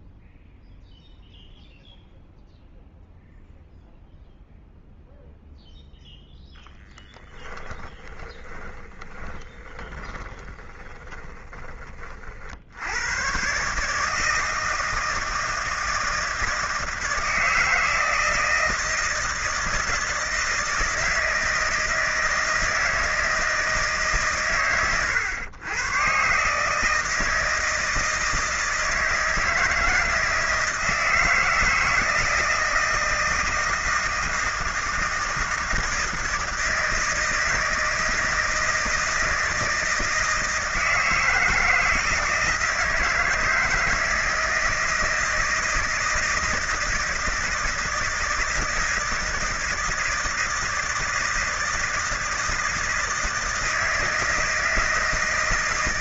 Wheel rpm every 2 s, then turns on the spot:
0, 0, 0, 0, 10, 20, 70, 160, 160, 160, 160, 160, 120, 150, 160, 160, 160, 160, 160, 160, 160, 160, 160, 160, 160, 160, 160, 160.
8-12